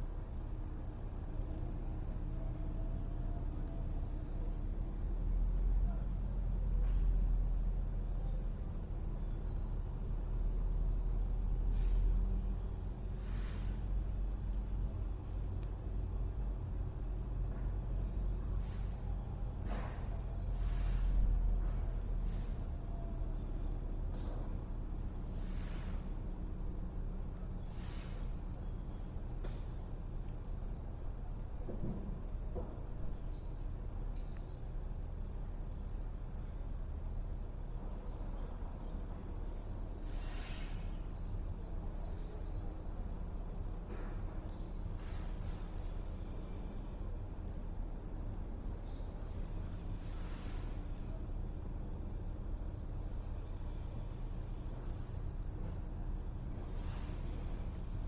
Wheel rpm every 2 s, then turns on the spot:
0, 0, 0, 0, 0, 0, 0, 0, 0, 0, 0, 0, 0, 0, 0, 0, 0, 0, 0, 0, 0, 0, 0, 0, 0, 0, 0, 0, 0.
none